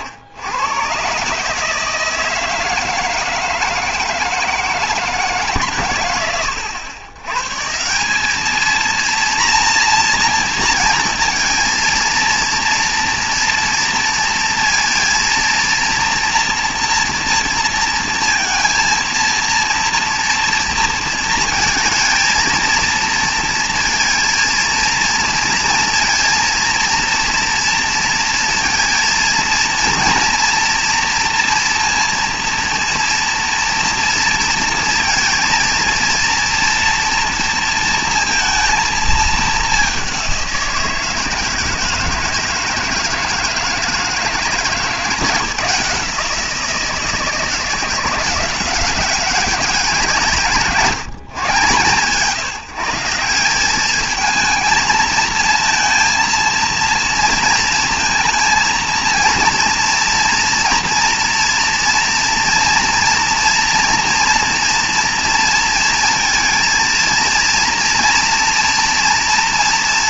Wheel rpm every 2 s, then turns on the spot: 100, 160, 160, 100, 220, 230, 230, 230, 230, 230, 230, 230, 230, 230, 230, 230, 230, 230, 230, 230, 180, 160, 150, 160, 170, 170, 170, 220, 230, 230, 230, 240, 240, 230, 230.
none